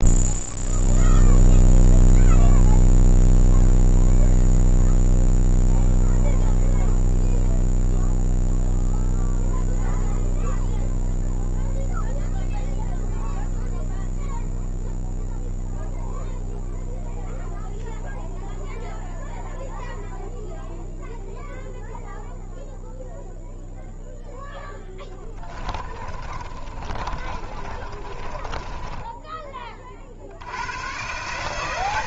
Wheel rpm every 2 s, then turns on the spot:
0, 0, 0, 0, 0, 0, 0, 0, 0, 0, 0, 0, 0, 30, 30, 60.
26-30